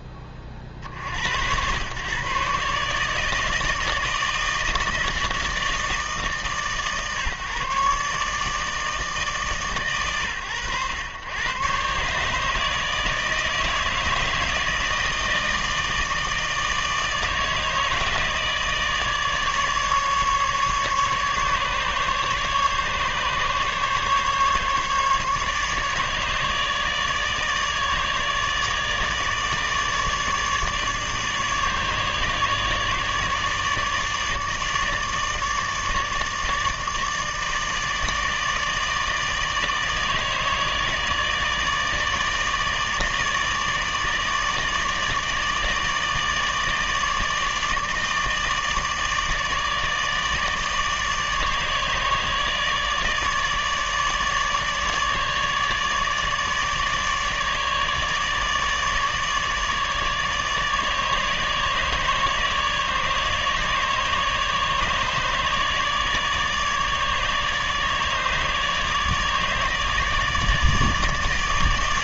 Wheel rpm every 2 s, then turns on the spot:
50, 150, 160, 150, 160, 110, 160, 160, 160, 160, 140, 140, 150, 160, 150, 150, 150, 150, 150, 160, 150, 150, 160, 160, 160, 150, 150, 150, 150, 150, 150, 150, 150, 150, 150, 150.
none